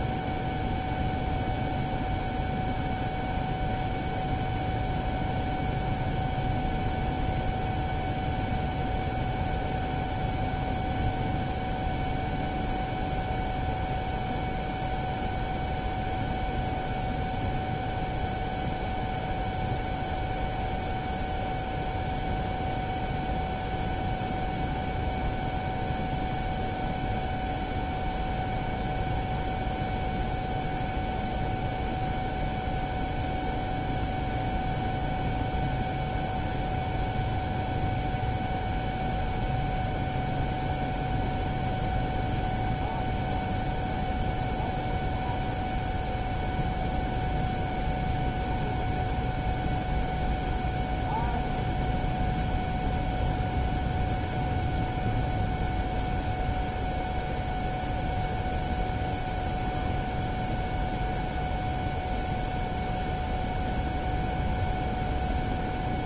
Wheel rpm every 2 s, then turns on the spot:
0, 0, 0, 0, 0, 0, 0, 0, 0, 0, 0, 0, 0, 0, 0, 0, 0, 0, 0, 0, 0, 0, 0, 0, 0, 0, 0, 0, 0, 0, 0, 0, 0.
none